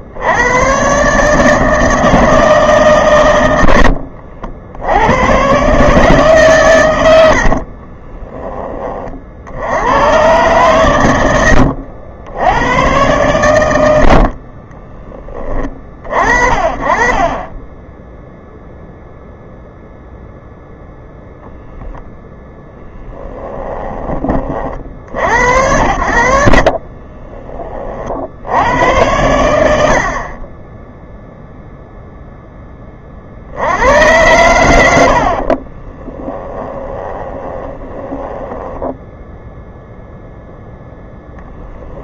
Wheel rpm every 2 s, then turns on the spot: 130, 140, 80, 120, 30, 120, 100, 20, 40, 0, 0, 10, 40, 40, 90, 10, 30, 80, 10, 10, 0.
14-18 22-24 26-28 36-40